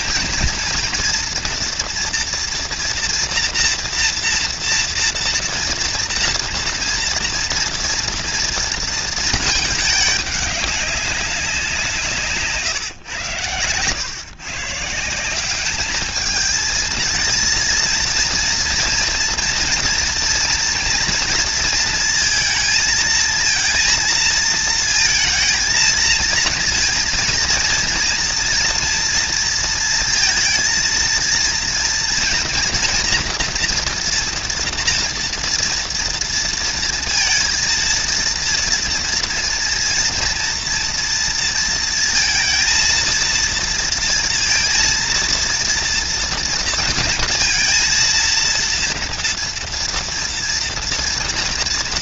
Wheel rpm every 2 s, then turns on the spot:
230, 230, 230, 230, 210, 150, 130, 210, 230, 230, 230, 230, 230, 230, 230, 230, 240, 230, 230, 230, 230, 230, 230, 230, 230, 230.
none